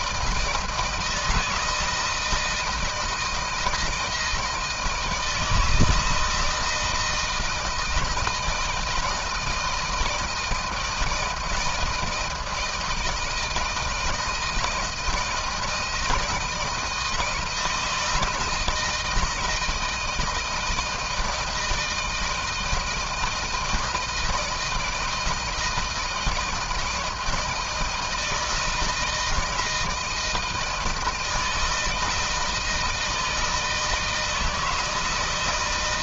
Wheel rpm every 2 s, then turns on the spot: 160, 160, 170, 160, 170, 160, 160, 160, 160, 160, 160, 160, 160, 160, 160, 160, 160, 160.
none